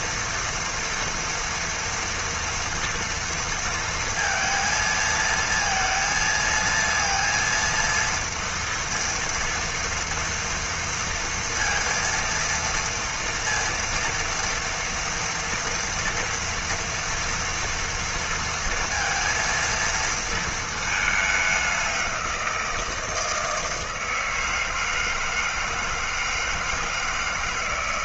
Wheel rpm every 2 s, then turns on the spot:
230, 230, 230, 230, 230, 230, 230, 230, 230, 230, 220, 170, 160, 160.
none